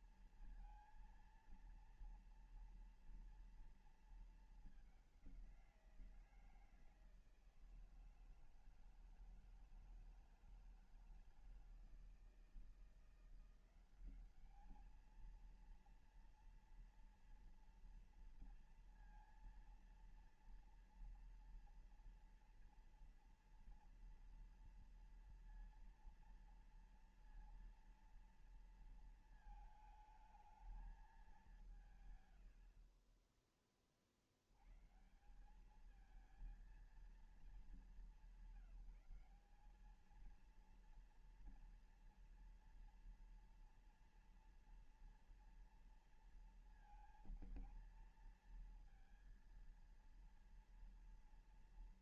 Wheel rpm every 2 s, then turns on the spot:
230, 240, 220, 170, 160, 160, 160, 190, 230, 230, 230, 230, 230, 230, 230, 220, 130, 60, 220, 180, 210, 240, 230, 230, 230, 230.
none